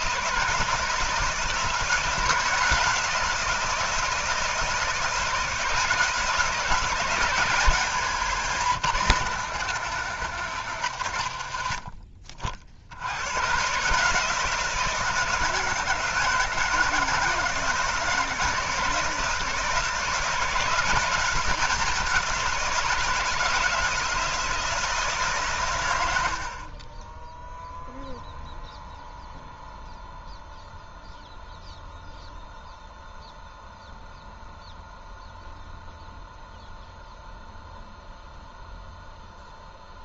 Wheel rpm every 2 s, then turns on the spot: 160, 160, 160, 160, 160, 140, 70, 160, 160, 160, 170, 170, 160, 30, 0, 0, 0, 0, 0, 0.
none